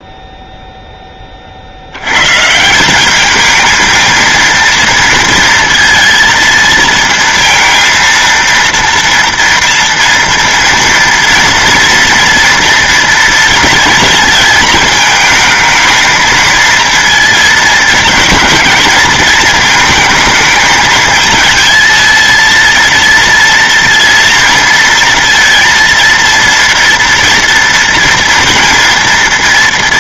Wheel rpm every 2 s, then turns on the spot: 0, 160, 230, 230, 230, 230, 230, 220, 230, 230, 220, 230, 230, 230, 230.
none